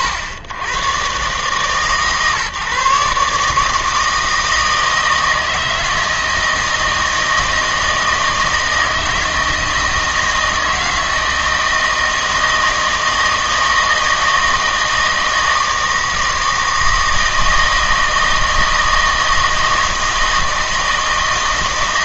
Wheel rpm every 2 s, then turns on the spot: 90, 140, 160, 160, 160, 160, 160, 160, 160, 160, 160.
none